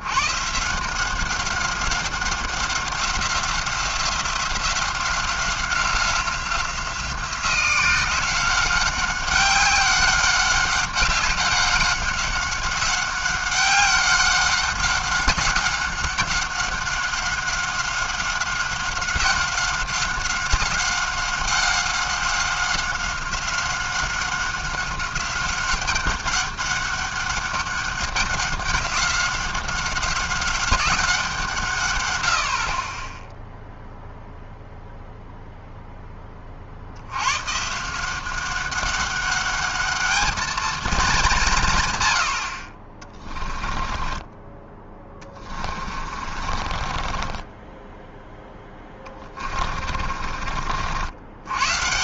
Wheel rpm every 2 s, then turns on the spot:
140, 190, 180, 180, 190, 190, 190, 190, 190, 190, 190, 190, 190, 200, 190, 190, 50, 0, 40, 190, 230, 60, 20, 40, 10, 50.
46-50